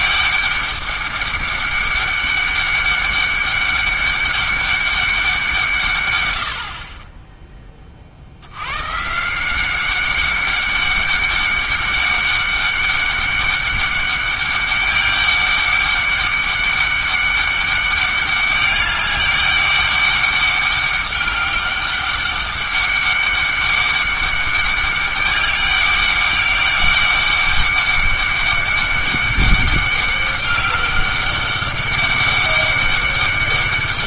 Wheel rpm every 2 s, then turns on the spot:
200, 200, 200, 70, 110, 200, 200, 200, 200, 200, 200, 200, 200, 200, 200, 200, 200.
none